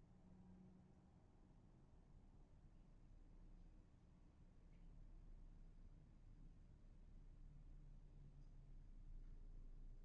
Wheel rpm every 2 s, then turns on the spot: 0, 0, 0, 0, 0.
none